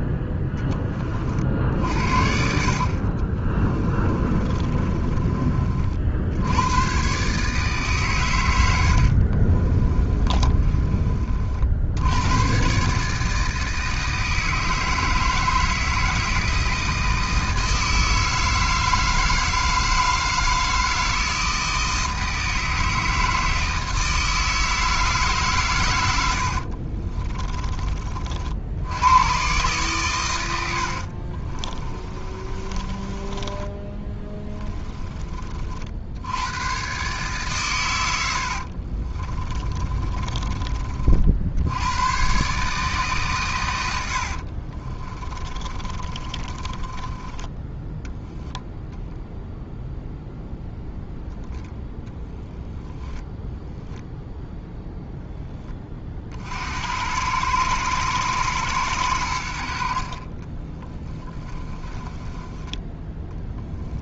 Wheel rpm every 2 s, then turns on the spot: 10, 50, 20, 100, 80, 30, 130, 160, 160, 160, 160, 160, 160, 60, 80, 80, 30, 20, 120, 60, 40, 140, 40, 20, 0, 0, 10, 0, 70, 110, 20, 10.
4-6 8-12 26-28 30-36 38-40 44-48 60-64